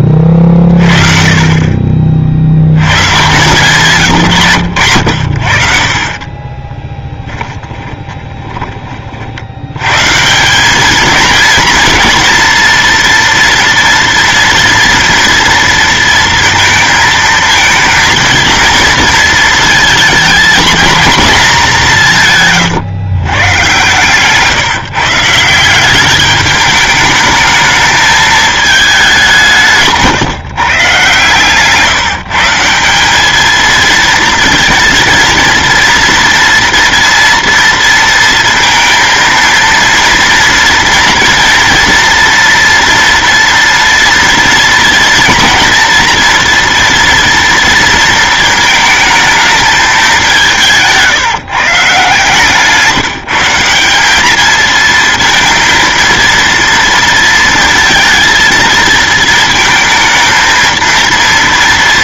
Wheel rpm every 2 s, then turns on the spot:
30, 90, 130, 20, 20, 180, 230, 230, 230, 230, 220, 150, 160, 210, 210, 140, 170, 220, 230, 230, 230, 230, 230, 230, 220, 180, 160, 220, 230, 230, 230.
6-8 22-24